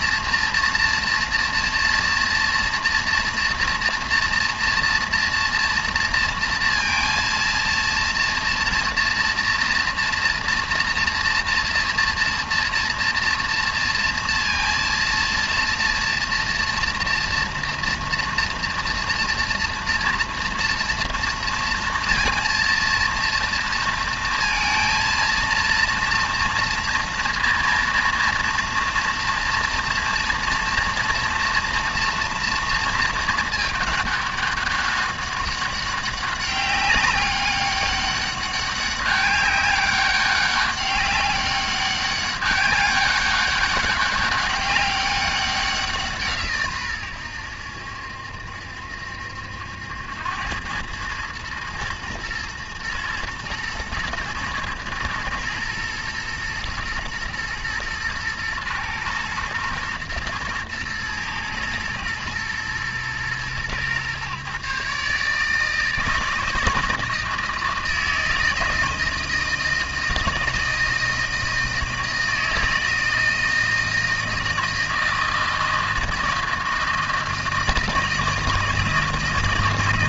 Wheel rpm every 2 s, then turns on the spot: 230, 230, 230, 230, 230, 230, 230, 230, 230, 230, 240, 230, 220, 230, 230, 230, 230, 200, 200, 200, 200, 200, 200, 130, 70, 100, 110, 120, 120, 110, 110, 120, 140, 160, 160, 160, 160, 160, 160, 160.
none